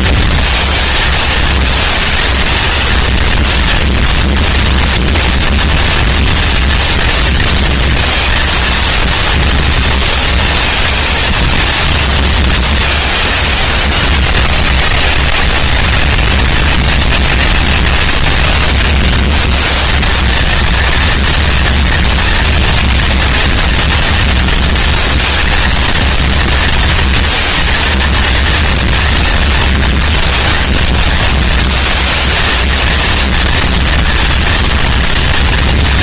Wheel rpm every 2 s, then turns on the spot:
230, 220, 230, 230, 230, 230, 230, 200, 200, 200, 220, 230, 230, 230, 230, 230, 230, 230.
none